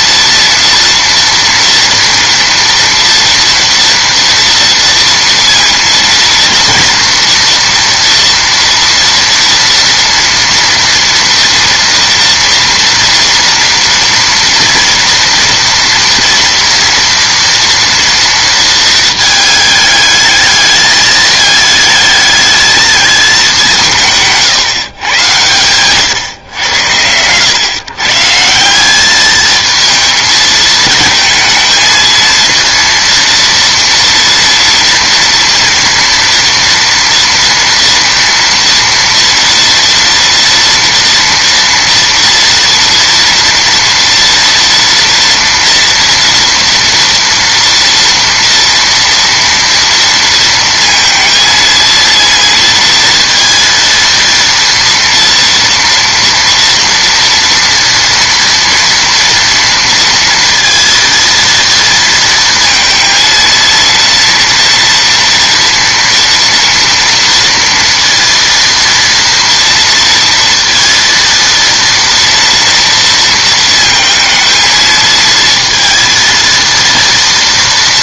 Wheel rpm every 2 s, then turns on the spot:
230, 230, 230, 230, 230, 230, 230, 230, 230, 230, 220, 220, 150, 100, 180, 220, 230, 230, 240, 230, 230, 230, 230, 230, 230, 230, 230, 230, 230, 230, 230, 230, 230, 230, 230, 230, 230, 220, 230.
none